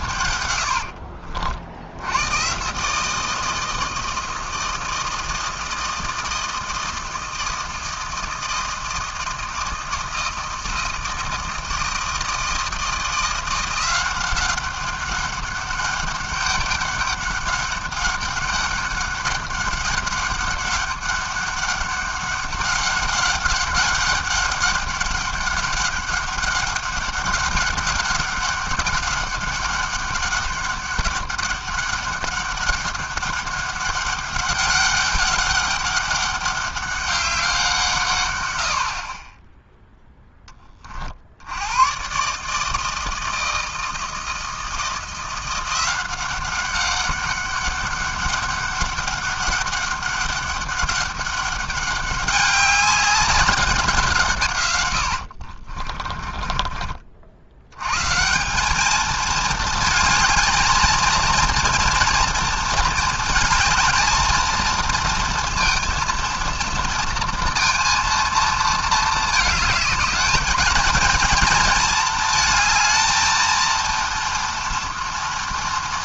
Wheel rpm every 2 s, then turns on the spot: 80, 130, 160, 160, 160, 160, 160, 190, 200, 200, 200, 200, 200, 200, 200, 200, 200, 200, 200, 70, 30, 150, 160, 190, 200, 200, 200, 110, 40, 210, 220, 230, 220, 230, 220, 220, 230, 240.
0-2 56-58